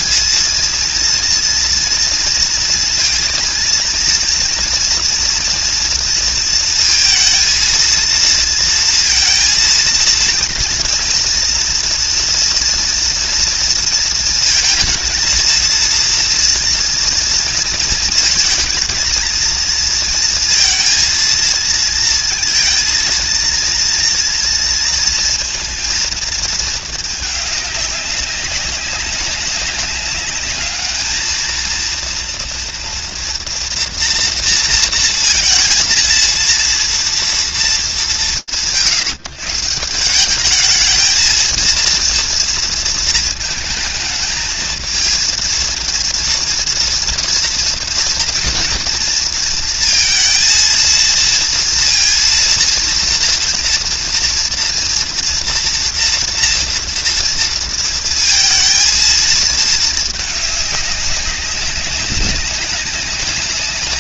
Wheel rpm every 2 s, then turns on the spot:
230, 230, 240, 230, 230, 240, 230, 220, 230, 220, 230, 230, 230, 220, 190, 210, 230, 230, 230, 150, 190, 230, 220, 230, 230, 230, 230, 230, 230, 230, 210, 190.
none